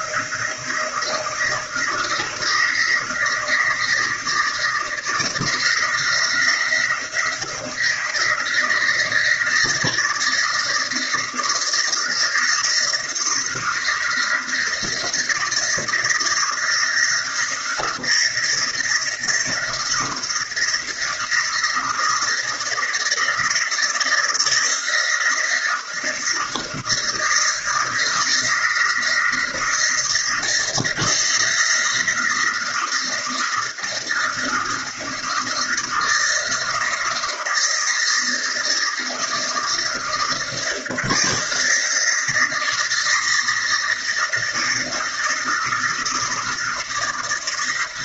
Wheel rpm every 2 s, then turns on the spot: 160, 170, 170, 170, 170, 160, 170, 170, 160, 160, 160, 160, 170, 160, 160, 160, 160, 160, 160, 170, 160, 160, 160, 160.
none